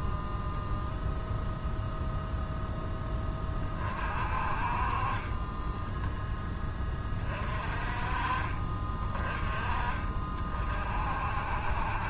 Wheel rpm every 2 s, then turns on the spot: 10, 0, 40, 10, 40, 50.
none